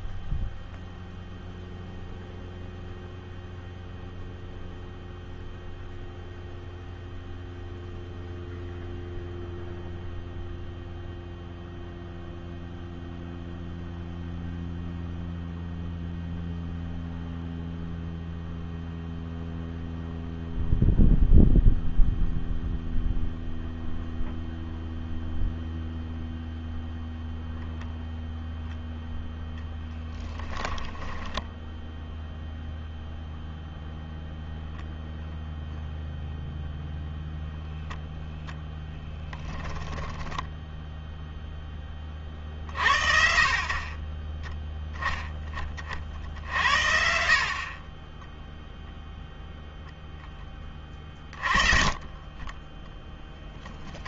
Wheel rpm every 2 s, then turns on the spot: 0, 0, 0, 0, 0, 0, 0, 0, 0, 0, 0, 0, 0, 0, 0, 10, 0, 0, 0, 0, 10, 40, 20, 50, 10, 10, 30.
30-32